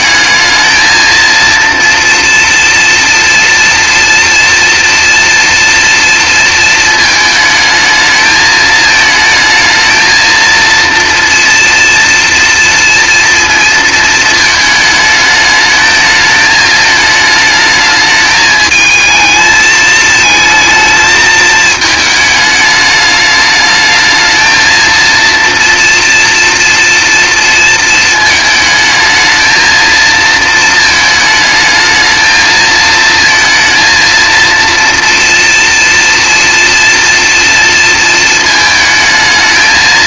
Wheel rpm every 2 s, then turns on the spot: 220, 240, 230, 220, 220, 230, 230, 220, 220, 220, 220, 210, 230, 230, 220, 220, 230, 230, 230, 220.
none